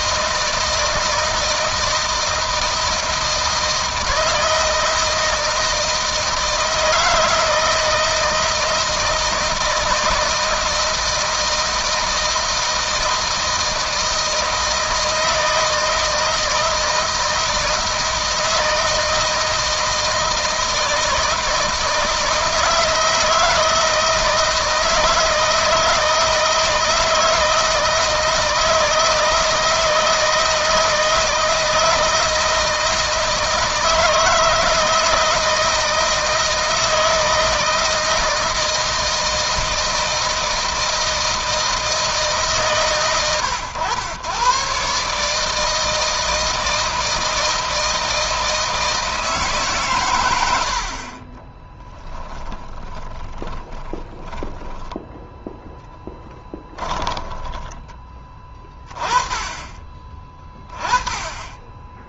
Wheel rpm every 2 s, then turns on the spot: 160, 160, 160, 160, 160, 160, 160, 160, 160, 160, 160, 160, 160, 170, 160, 160, 160, 160, 160, 160, 160, 130, 130, 160, 160, 60, 30, 10, 10, 20, 20.
52-54 56-58